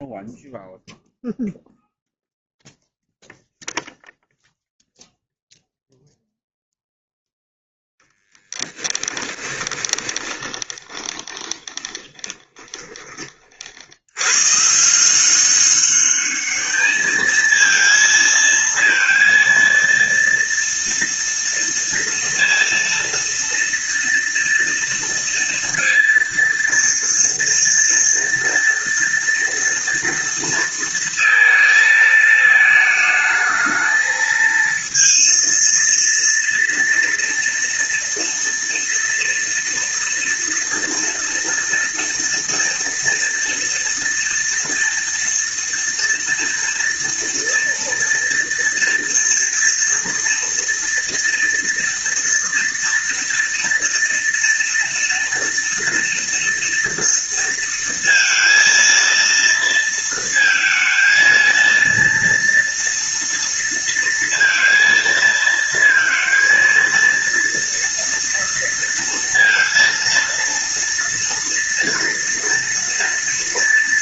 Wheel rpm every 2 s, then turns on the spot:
0, 0, 0, 0, 10, 20, 40, 180, 220, 230, 230, 230, 230, 230, 240, 230, 220, 230, 230, 230, 230, 230, 230, 230, 230, 230, 230, 230, 230, 230, 230, 230, 230, 230, 230, 230, 230.
8-12